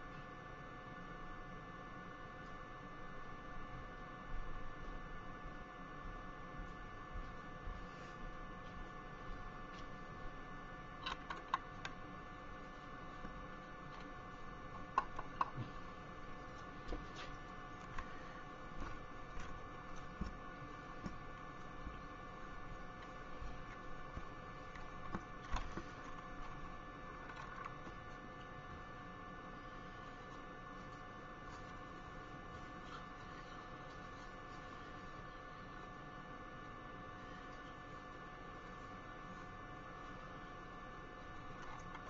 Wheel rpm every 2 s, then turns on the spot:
0, 0, 0, 0, 0, 0, 0, 0, 0, 0, 0, 0, 0, 0, 0, 0, 0, 0, 0, 0, 0.
none